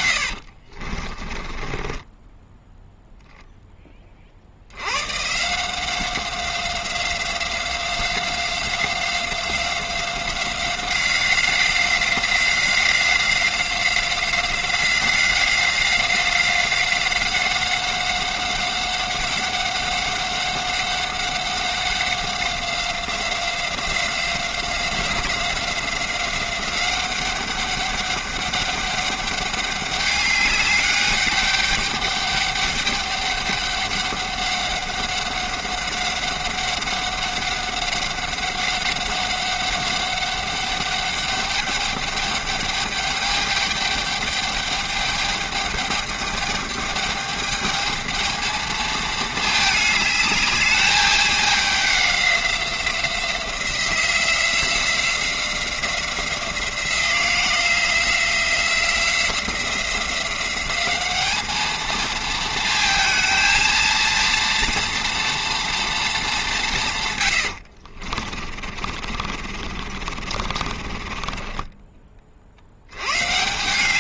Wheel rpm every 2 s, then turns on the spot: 50, 0, 80, 180, 190, 190, 190, 180, 190, 190, 190, 180, 180, 190, 200, 200, 200, 200, 190, 190, 200, 210, 210, 210, 220, 210, 180, 180, 180, 180, 190, 220, 230, 180, 50, 40, 80.
0-2 68-72